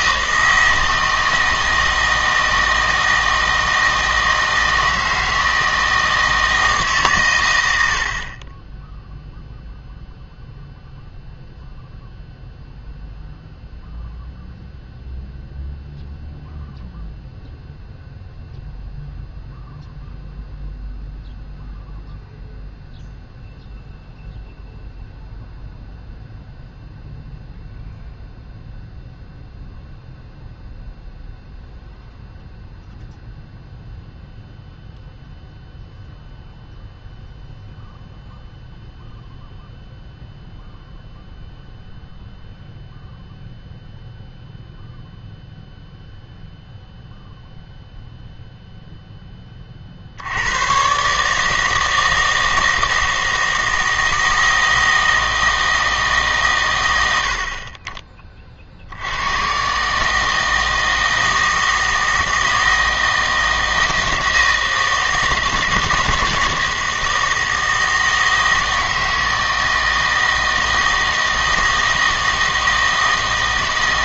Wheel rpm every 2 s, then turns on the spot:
160, 160, 160, 150, 20, 0, 0, 0, 0, 0, 0, 0, 0, 0, 0, 0, 0, 0, 0, 0, 0, 0, 0, 0, 0, 110, 160, 160, 110, 50, 160, 160, 160, 160, 160, 160, 160.
none